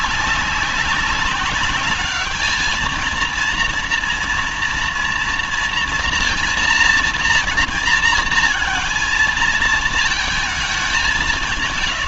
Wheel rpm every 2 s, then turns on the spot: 190, 220, 230, 230, 230, 200.
none